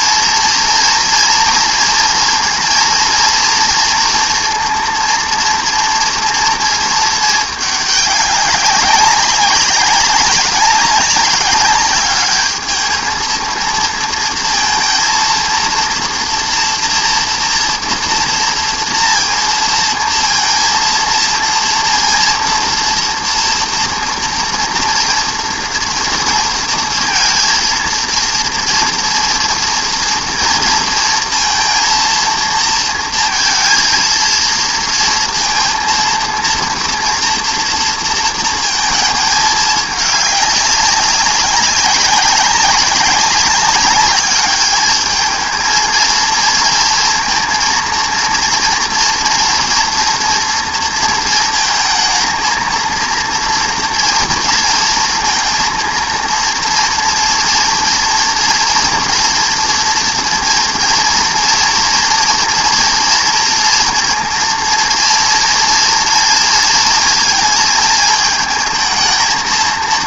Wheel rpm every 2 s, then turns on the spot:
230, 230, 230, 230, 200, 200, 210, 230, 230, 230, 230, 230, 230, 230, 230, 230, 230, 230, 230, 230, 200, 200, 210, 230, 230, 230, 230, 230, 230, 230, 240, 230, 230, 230, 220.
none